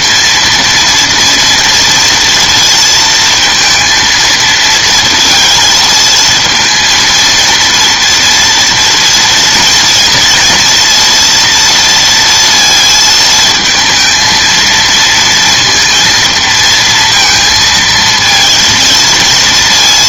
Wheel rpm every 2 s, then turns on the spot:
240, 230, 230, 230, 230, 230, 230, 230, 230, 230.
none